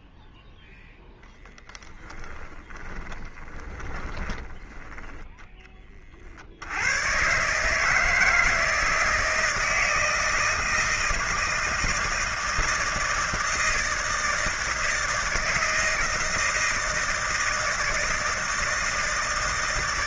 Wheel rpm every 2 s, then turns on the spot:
0, 10, 20, 70, 160, 160, 160, 160, 160, 160.
2-6